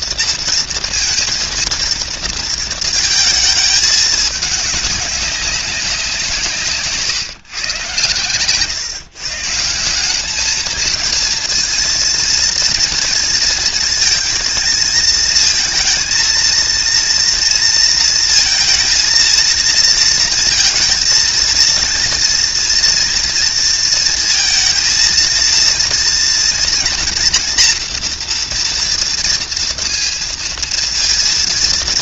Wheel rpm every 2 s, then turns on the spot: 230, 220, 210, 160, 130, 220, 230, 230, 230, 230, 220, 230, 230, 240, 240, 230.
none